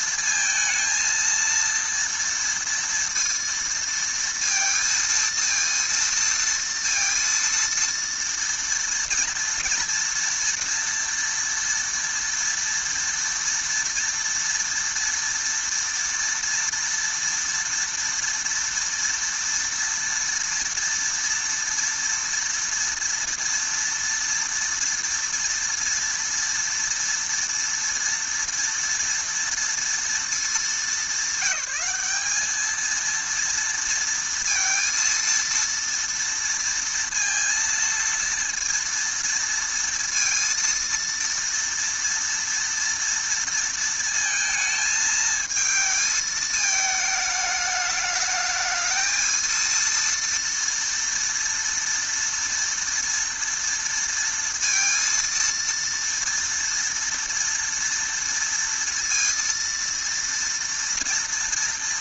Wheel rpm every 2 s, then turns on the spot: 230, 230, 230, 230, 230, 230, 230, 230, 230, 230, 230, 230, 230, 230, 230, 210, 220, 230, 230, 230, 230, 230, 220, 220, 220, 230, 240, 230, 230, 230, 240.
none